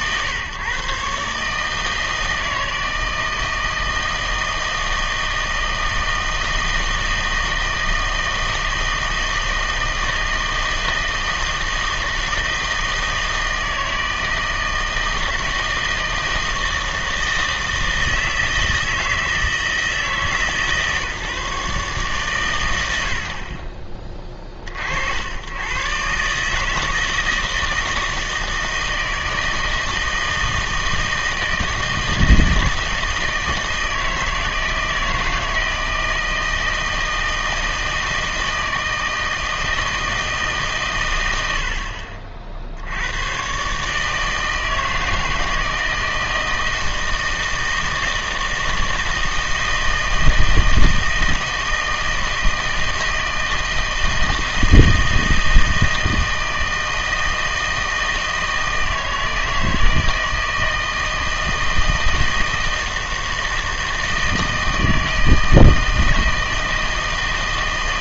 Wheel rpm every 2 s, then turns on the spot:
140, 160, 160, 160, 160, 160, 160, 160, 160, 160, 150, 90, 50, 160, 160, 160, 160, 170, 160, 160, 140, 70, 160, 160, 160, 160, 160, 160, 160, 160, 160, 160, 160, 160.
none